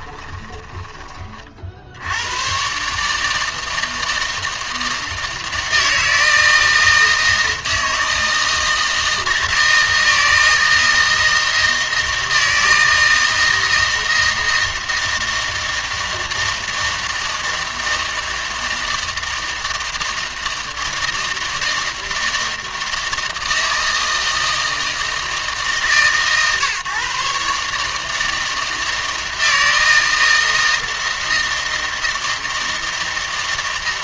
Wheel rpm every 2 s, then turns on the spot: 20, 130, 160, 160, 160, 160, 160, 160, 160, 160, 160, 160, 160, 140, 160, 160, 160.
none